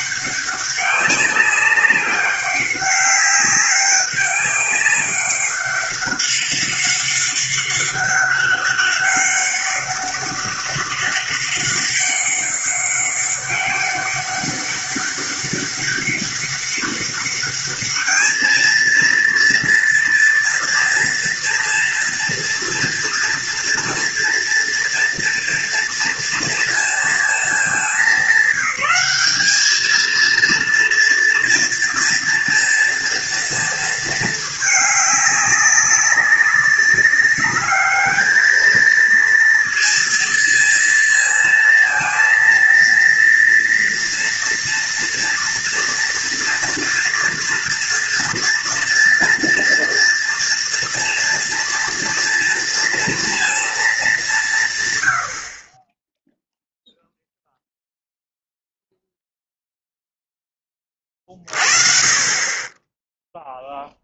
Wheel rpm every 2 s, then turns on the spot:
200, 200, 200, 200, 200, 200, 200, 200, 200, 220, 240, 240, 230, 230, 200, 230, 230, 220, 200, 220, 230, 230, 230, 240, 230, 230, 230, 150, 0, 0, 10, 40.
none